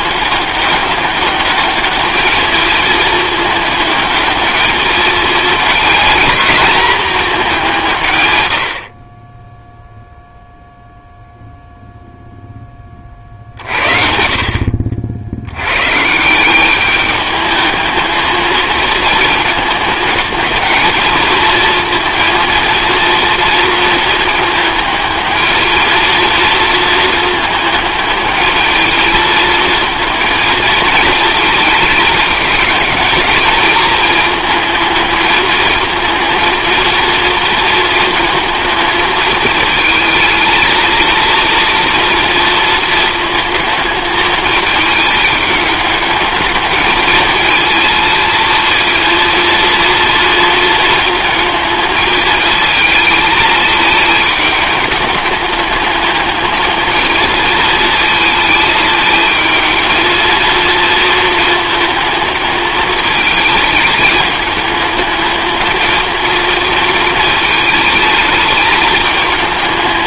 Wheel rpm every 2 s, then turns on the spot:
200, 220, 220, 220, 60, 0, 20, 60, 200, 220, 220, 230, 210, 230, 220, 220, 210, 220, 230, 220, 230, 230, 220, 220, 230, 220, 220, 210, 220, 220, 230, 220, 210, 230, 220.
none